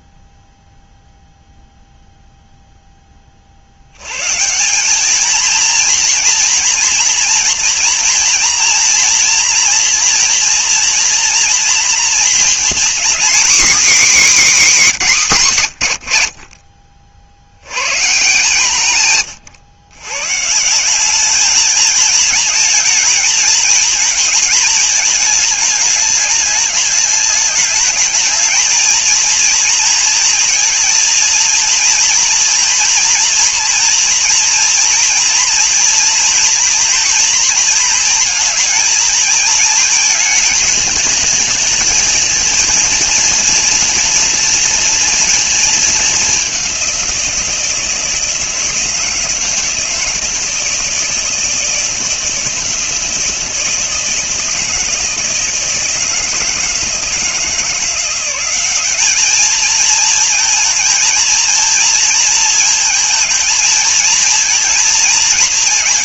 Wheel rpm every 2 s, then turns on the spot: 0, 10, 190, 240, 240, 240, 240, 240, 40, 150, 180, 220, 220, 210, 230, 230, 230, 230, 230, 220, 220, 230, 230, 190, 160, 160, 160, 160, 160, 200, 220, 230, 230.
none